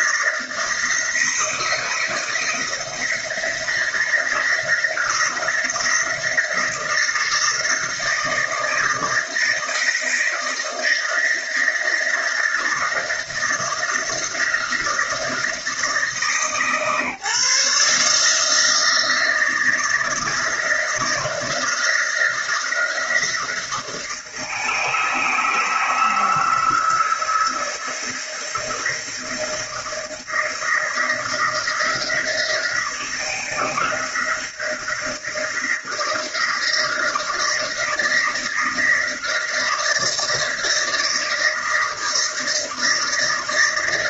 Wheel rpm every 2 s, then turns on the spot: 160, 170, 160, 160, 160, 160, 160, 160, 150, 160, 160, 170, 160, 160, 160, 170, 170, 160, 160, 160, 160, 160.
none